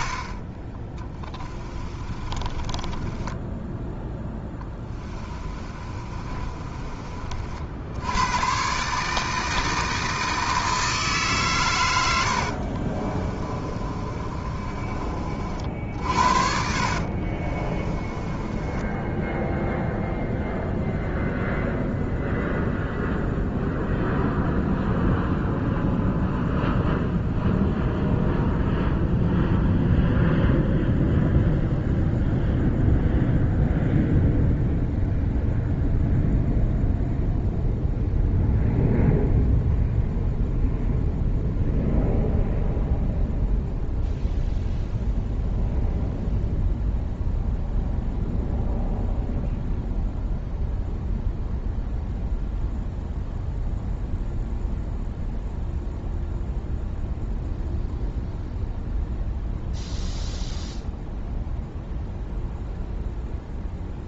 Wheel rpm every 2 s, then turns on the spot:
30, 20, 10, 30, 130, 160, 50, 30, 60, 20, 0, 0, 0, 0, 0, 0, 0, 0, 0, 0, 0, 0, 0, 0, 0, 0, 0, 0, 0, 0, 0, 0.
2-8 12-20